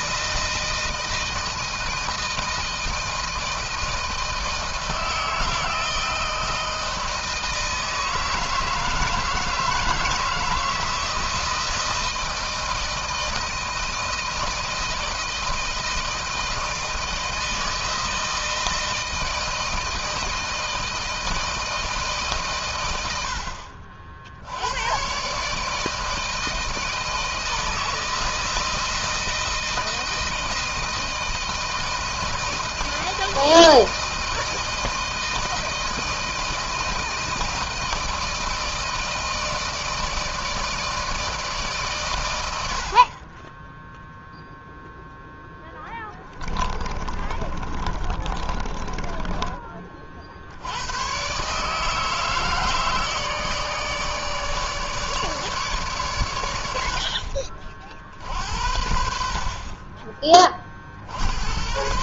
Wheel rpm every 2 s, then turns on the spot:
160, 160, 160, 160, 160, 160, 170, 160, 160, 160, 160, 130, 80, 160, 160, 160, 160, 160, 160, 160, 160, 110, 0, 20, 30, 70, 160, 150, 100, 60, 30.
46-50